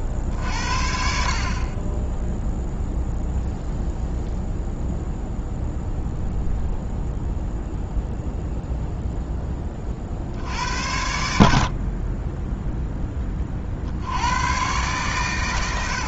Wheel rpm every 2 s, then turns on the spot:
50, 0, 0, 0, 0, 70, 10, 120.
none